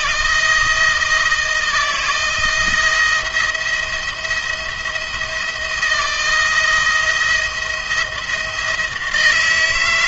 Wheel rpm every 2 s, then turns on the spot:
170, 170, 170, 170, 170.
none